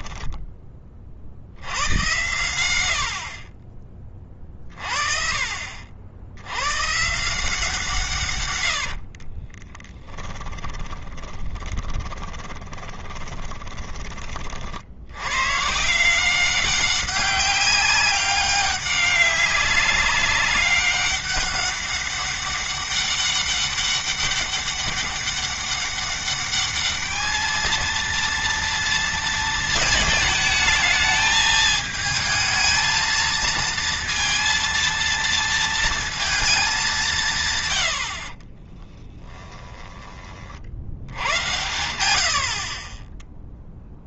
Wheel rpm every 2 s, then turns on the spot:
30, 70, 40, 120, 80, 20, 20, 60, 190, 200, 200, 200, 200, 210, 230, 220, 230, 230, 190, 10, 70, 40.
8-14 38-40